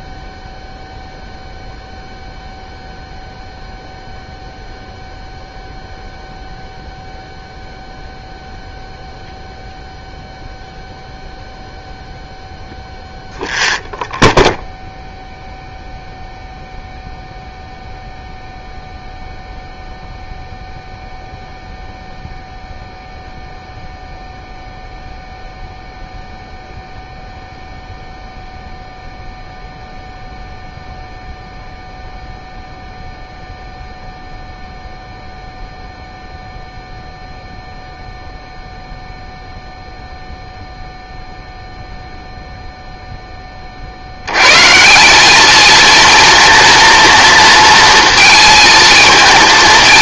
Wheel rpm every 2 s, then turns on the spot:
0, 0, 0, 0, 0, 0, 0, 0, 0, 0, 0, 0, 0, 0, 0, 0, 0, 0, 0, 0, 0, 0, 140, 230, 220.
none